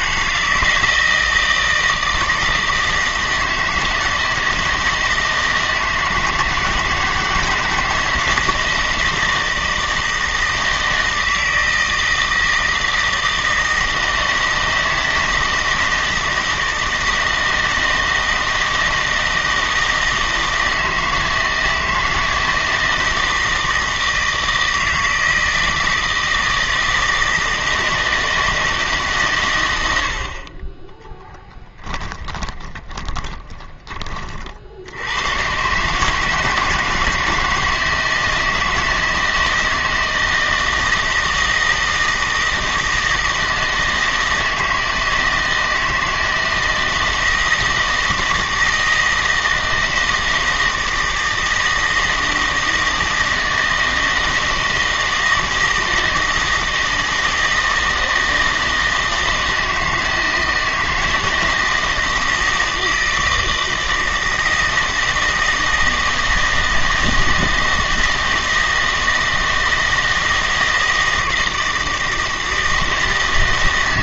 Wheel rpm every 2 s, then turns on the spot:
160, 160, 160, 160, 160, 160, 160, 160, 160, 160, 160, 160, 160, 160, 160, 20, 20, 50, 160, 160, 160, 160, 160, 160, 160, 160, 160, 160, 160, 160, 160, 160, 160, 160, 160, 160, 160.
32-34